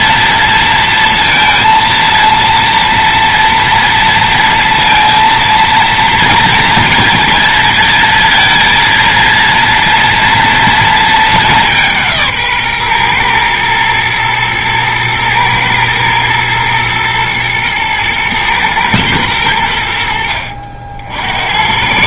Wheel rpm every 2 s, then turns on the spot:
230, 230, 230, 230, 230, 230, 130, 110, 120, 120, 60.
none